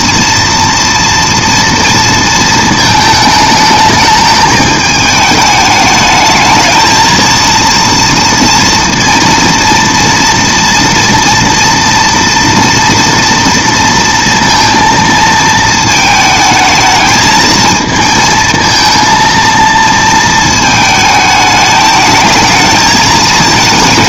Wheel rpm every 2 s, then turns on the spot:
230, 220, 210, 230, 230, 240, 230, 230, 220, 230, 220, 220.
none